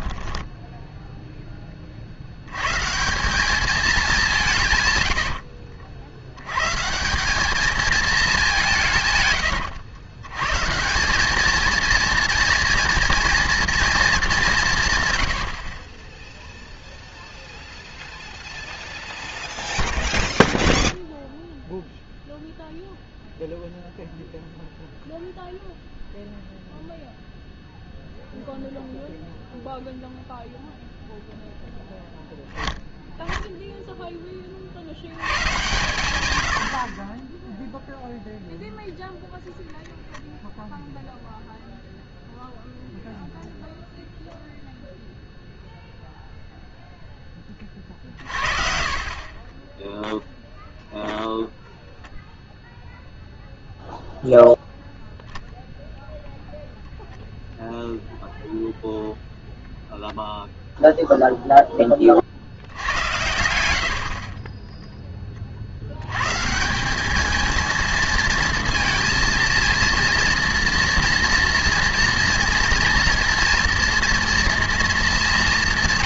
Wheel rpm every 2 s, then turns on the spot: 10, 140, 140, 150, 160, 180, 230, 160, 0, 0, 0, 0, 0, 0, 0, 0, 0, 80, 50, 0, 0, 0, 0, 0, 40, 0, 0, 0, 0, 0, 0, 90, 10, 180, 230, 230, 230, 230.
none